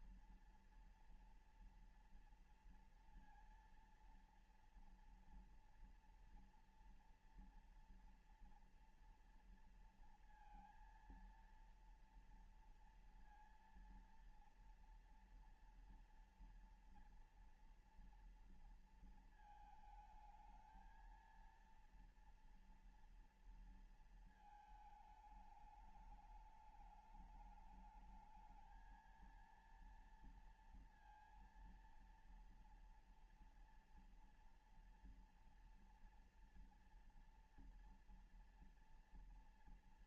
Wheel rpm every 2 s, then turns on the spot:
230, 230, 230, 230, 230, 230, 230, 230, 230, 230, 220, 230, 220, 210, 210, 230, 230, 240, 240, 240.
none